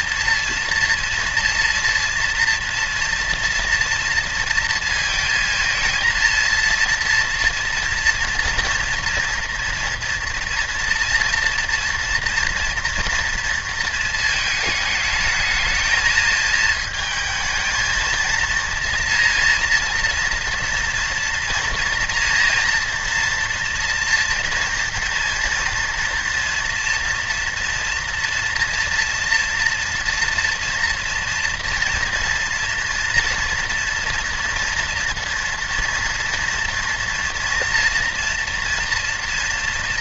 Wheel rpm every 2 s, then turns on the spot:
230, 240, 230, 230, 230, 230, 230, 220, 220, 230, 240, 240, 240, 230, 230, 230, 230, 230, 230, 240.
none